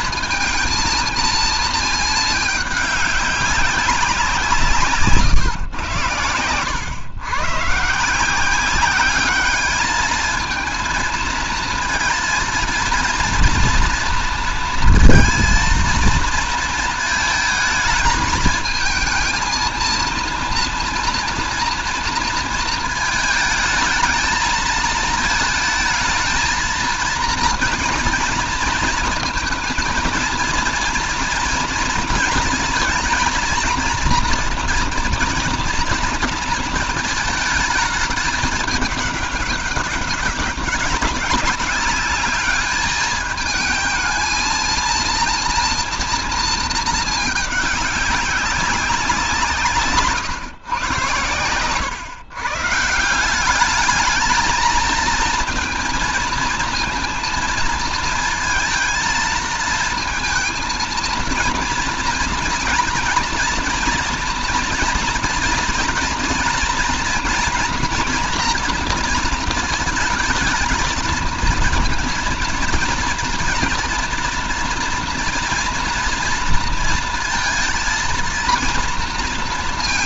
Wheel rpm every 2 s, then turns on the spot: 220, 210, 170, 100, 180, 220, 230, 230, 230, 220, 230, 220, 220, 230, 230, 230, 230, 230, 230, 210, 190, 210, 230, 230, 190, 110, 140, 220, 230, 230, 220, 230, 230, 230, 230, 220, 230, 230, 230, 230.
none